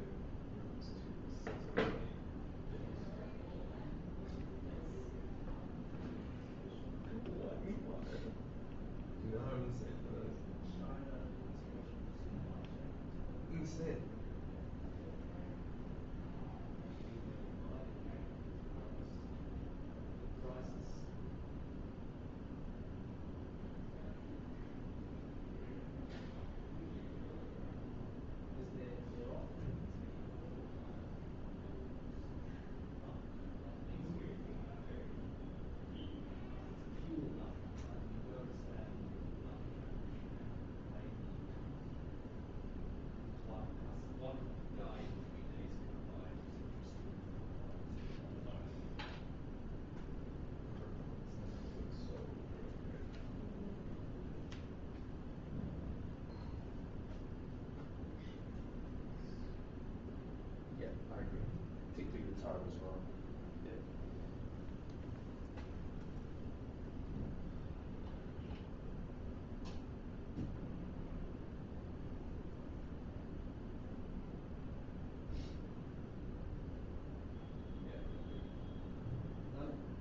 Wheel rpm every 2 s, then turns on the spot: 0, 0, 0, 0, 0, 0, 0, 0, 0, 0, 0, 0, 0, 0, 0, 0, 0, 0, 0, 0, 0, 0, 0, 0, 0, 0, 0, 0, 0, 0, 0, 0, 0, 0, 0, 0, 0, 0, 0, 0.
none